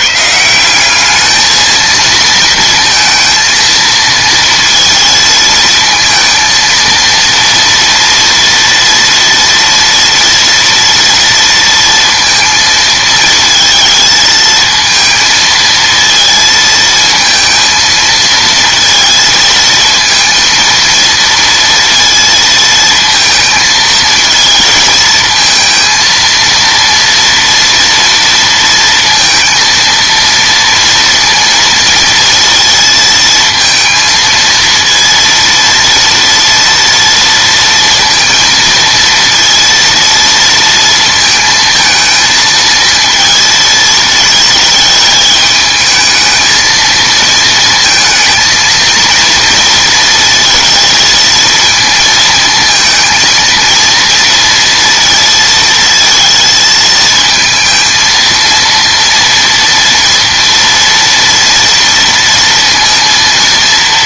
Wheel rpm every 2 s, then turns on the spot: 170, 220, 230, 230, 230, 230, 230, 220, 220, 230, 230, 230, 220, 230, 230, 230, 230, 230, 230, 230, 230, 230, 220, 220, 230, 230, 220, 230, 230, 230, 230, 230.
none